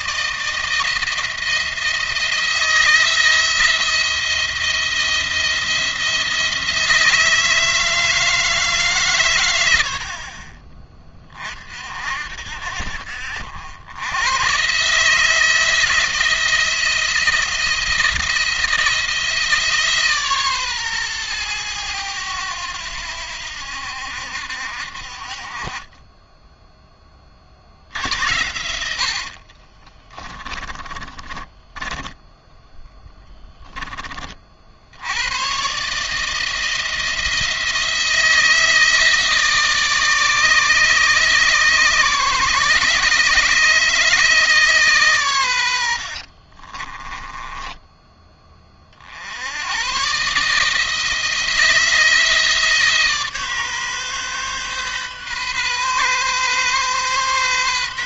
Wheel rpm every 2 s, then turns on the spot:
160, 170, 170, 160, 150, 30, 60, 130, 170, 170, 130, 90, 60, 10, 80, 30, 10, 50, 160, 160, 150, 140, 150, 50, 30, 150, 160, 130, 130.
28-34 46-48